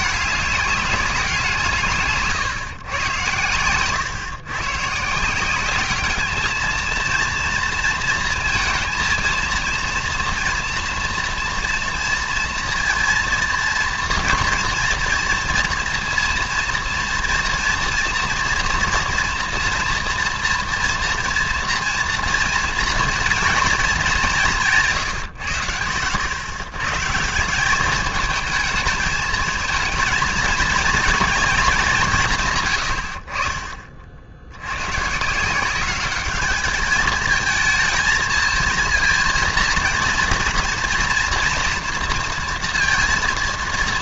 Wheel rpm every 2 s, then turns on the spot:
200, 130, 130, 220, 230, 230, 230, 230, 230, 230, 230, 230, 160, 130, 220, 230, 110, 80, 210, 230, 230, 240.
none